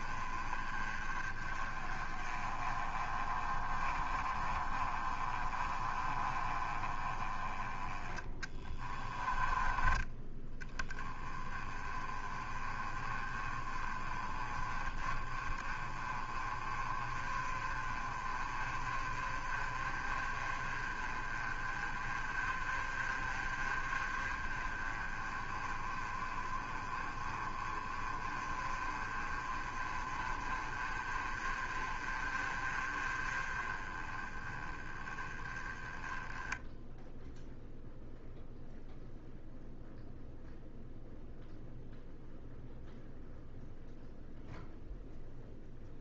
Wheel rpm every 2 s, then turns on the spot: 30, 30, 30, 20, 20, 10, 30, 20, 30, 30, 30, 30, 30, 30, 30, 30, 30, 20, 0, 0, 0, 0, 0.
8-10